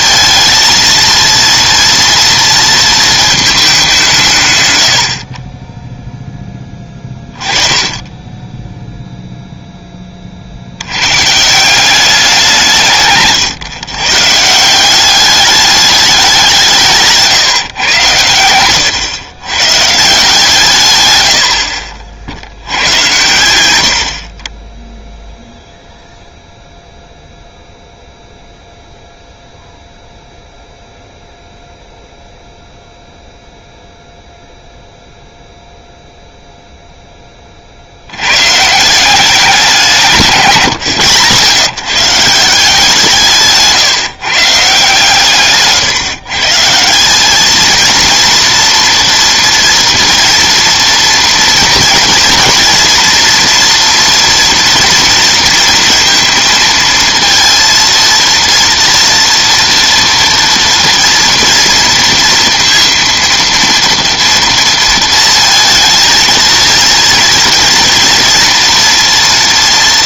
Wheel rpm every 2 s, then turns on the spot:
230, 230, 110, 20, 0, 70, 160, 170, 170, 110, 140, 100, 20, 0, 0, 0, 0, 0, 0, 150, 140, 160, 150, 150, 230, 230, 230, 230, 230, 230, 230, 230, 230, 230, 230.
none